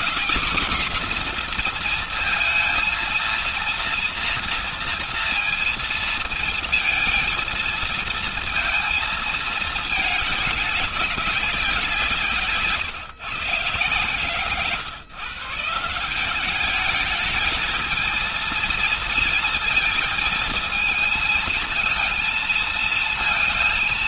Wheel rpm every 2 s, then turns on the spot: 250, 230, 230, 230, 230, 200, 140, 120, 190, 220, 220, 230.
none